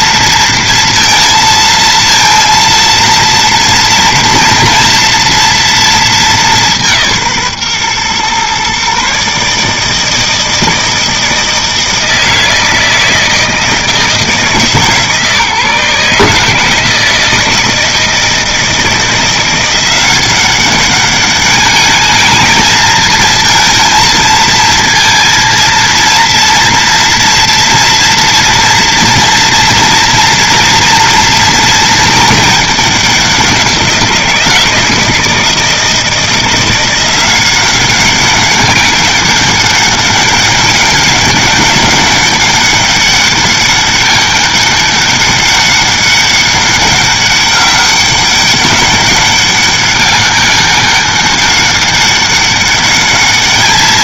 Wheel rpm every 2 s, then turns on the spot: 230, 230, 230, 200, 130, 160, 160, 160, 150, 160, 190, 220, 230, 230, 230, 230, 220, 170, 170, 190, 200, 200, 200, 200, 200, 200, 200.
none